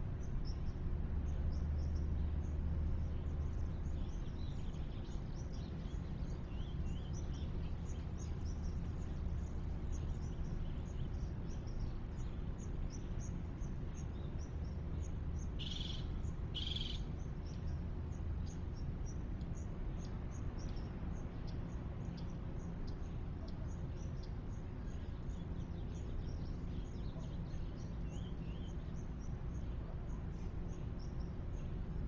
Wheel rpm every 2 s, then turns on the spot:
0, 0, 0, 0, 0, 0, 0, 0, 0, 0, 0, 0, 0, 0, 0, 0.
none